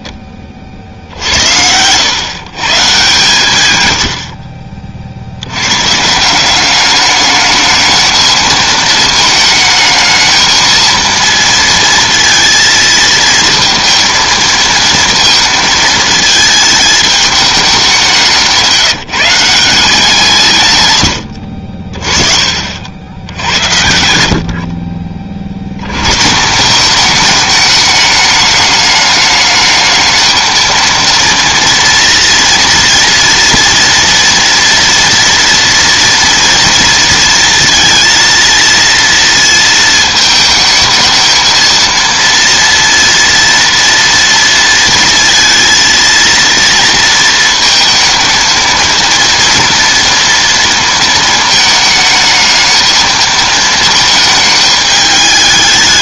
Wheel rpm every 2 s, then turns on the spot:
20, 130, 60, 180, 220, 220, 220, 230, 220, 180, 140, 60, 60, 180, 210, 230, 230, 230, 230, 230, 220, 230, 230, 230, 230, 230, 220, 220.
none